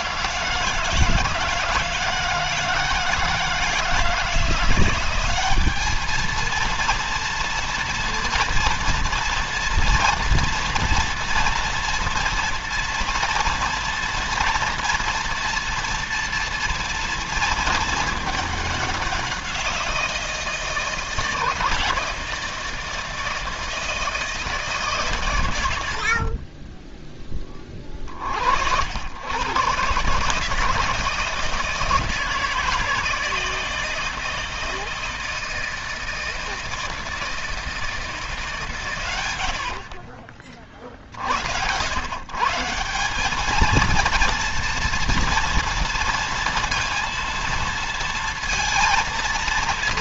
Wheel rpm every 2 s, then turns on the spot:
170, 160, 180, 230, 230, 230, 230, 240, 230, 200, 160, 160, 140, 20, 80, 150, 160, 160, 160, 120, 50, 170, 230, 230, 230.
none